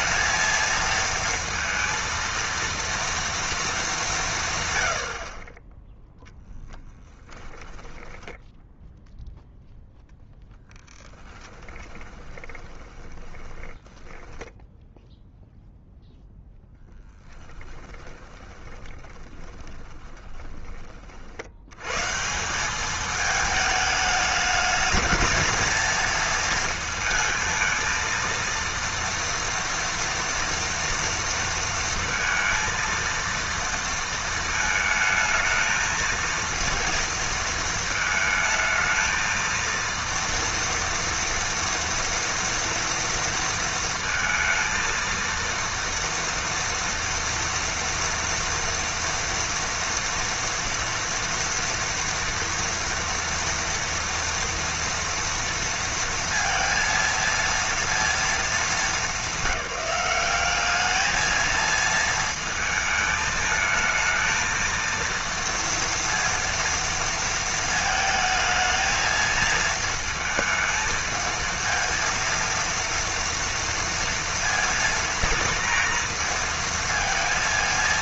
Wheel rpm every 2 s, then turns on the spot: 230, 230, 90, 20, 0, 10, 20, 0, 0, 20, 30, 200, 220, 220, 230, 230, 230, 220, 230, 220, 240, 230, 230, 230, 230, 230, 230, 230, 230, 220, 210, 220, 230, 230, 220, 220, 230, 230, 230.
6-8 10-14 18-20